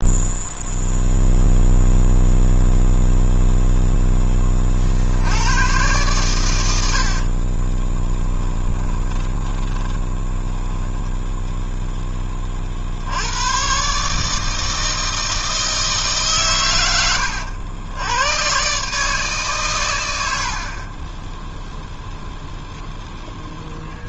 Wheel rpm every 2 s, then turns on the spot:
0, 0, 40, 90, 20, 10, 50, 160, 120, 140, 40, 0.
6-12